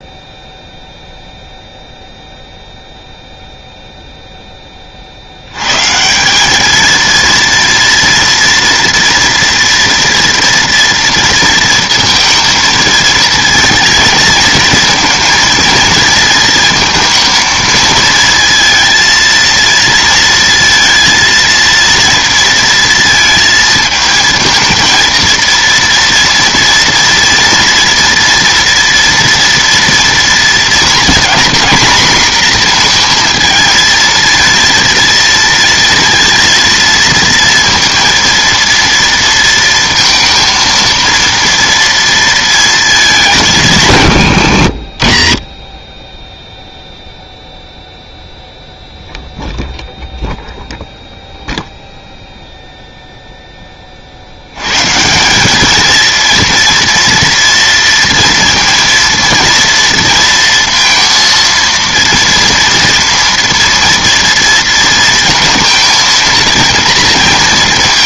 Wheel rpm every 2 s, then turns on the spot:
0, 0, 20, 210, 230, 230, 220, 230, 230, 230, 230, 230, 220, 230, 230, 230, 240, 230, 230, 230, 230, 230, 80, 0, 0, 0, 0, 100, 230, 230, 230, 230, 230, 230.
none